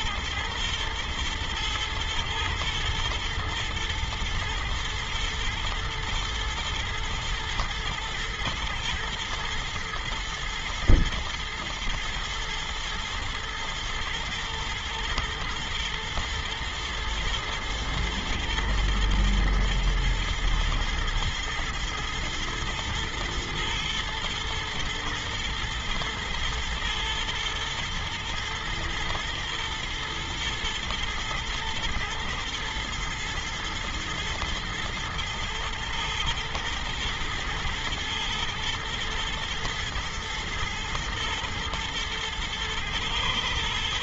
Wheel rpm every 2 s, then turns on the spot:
120, 110, 110, 110, 110, 110, 120, 120, 120, 120, 110, 110, 120, 110, 110, 120, 110, 120, 120, 110, 110, 110.
none